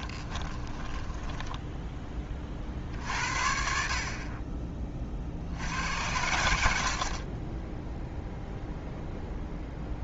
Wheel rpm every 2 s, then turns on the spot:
20, 50, 30, 70, 0.
0-2